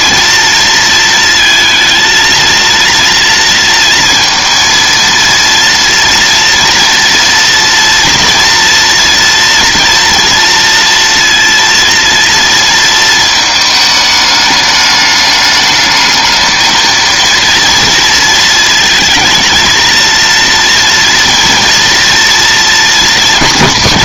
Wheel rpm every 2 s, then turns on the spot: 230, 230, 230, 230, 240, 230, 220, 210, 230, 230, 230, 210.
none